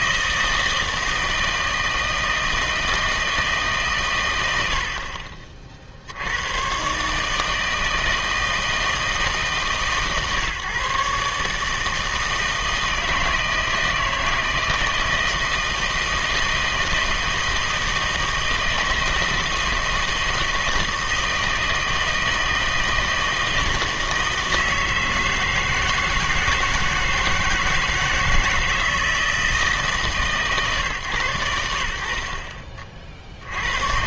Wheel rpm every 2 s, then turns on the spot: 160, 160, 80, 110, 160, 140, 160, 160, 160, 160, 160, 160, 160, 160, 160, 140, 50.
none